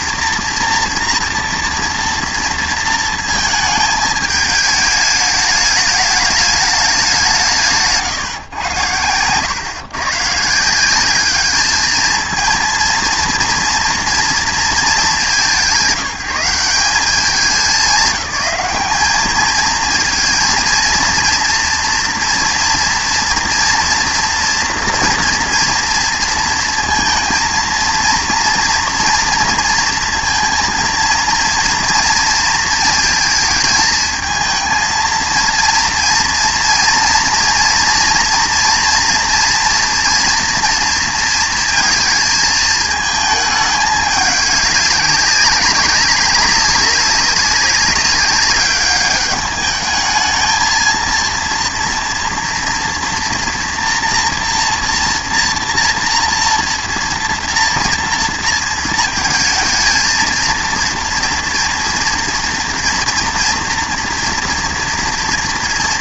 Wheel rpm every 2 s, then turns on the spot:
230, 230, 210, 210, 110, 160, 230, 220, 180, 200, 230, 240, 230, 230, 230, 230, 230, 220, 230, 230, 230, 220, 200, 200, 200, 220, 230, 230, 230, 230, 230, 230, 230.
none